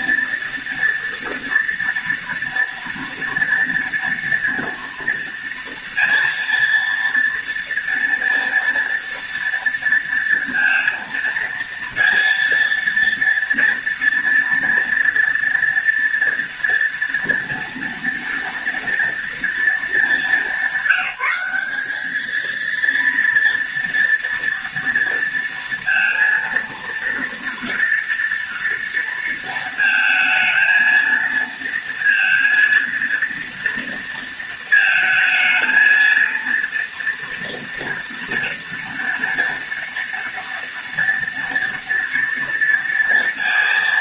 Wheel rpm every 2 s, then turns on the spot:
230, 230, 230, 230, 230, 230, 230, 230, 230, 230, 200, 230, 230, 230, 230, 220, 230, 220, 230, 230, 240, 230.
none